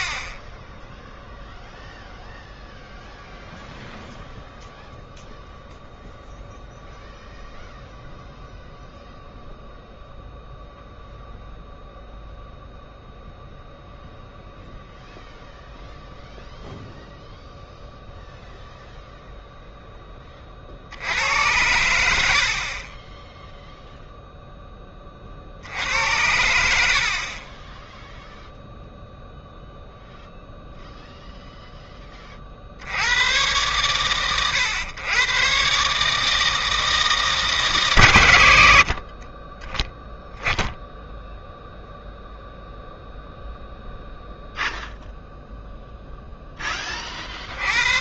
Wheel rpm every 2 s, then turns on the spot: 10, 0, 0, 0, 0, 0, 0, 0, 0, 0, 60, 40, 0, 80, 0, 0, 60, 110, 160, 90, 10, 0, 0, 20.
none